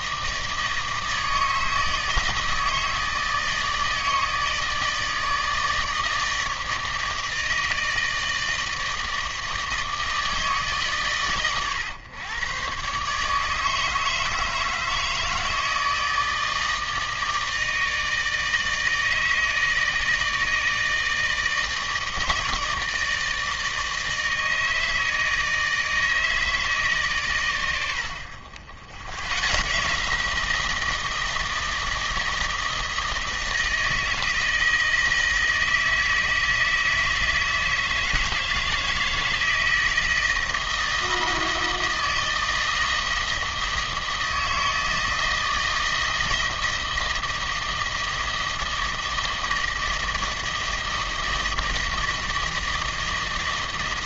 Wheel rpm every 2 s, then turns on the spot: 160, 160, 160, 160, 160, 140, 130, 150, 160, 160, 160, 160, 160, 150, 60, 170, 160, 160, 160, 160, 160, 160, 160, 160, 160, 160, 160.
none